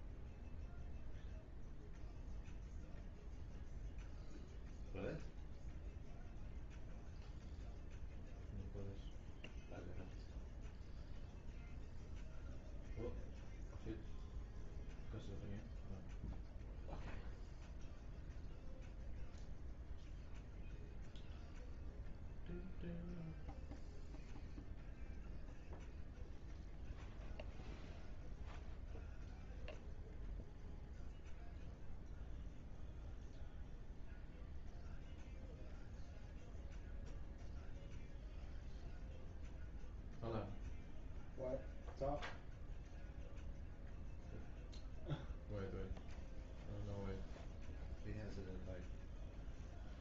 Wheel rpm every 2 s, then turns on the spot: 0, 0, 0, 0, 0, 0, 0, 0, 0, 0, 0, 0, 0, 0, 0, 0, 0, 0, 0, 0, 0, 0, 0, 0, 0.
none